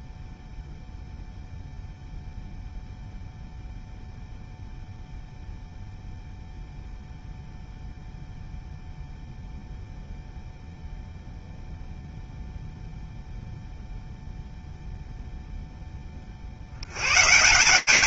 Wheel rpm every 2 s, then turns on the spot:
0, 0, 0, 0, 0, 0, 0, 0, 180.
none